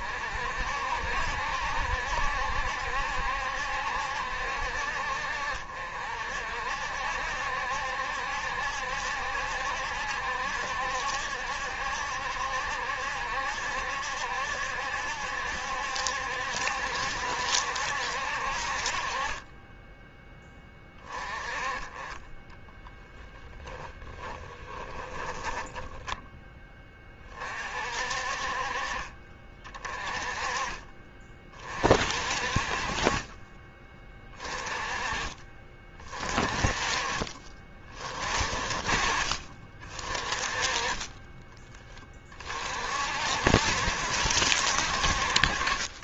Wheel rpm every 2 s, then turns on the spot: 60, 70, 60, 60, 70, 70, 70, 70, 70, 50, 20, 20, 20, 20, 40, 30, 30, 30, 30, 30, 20, 50, 60.
22-26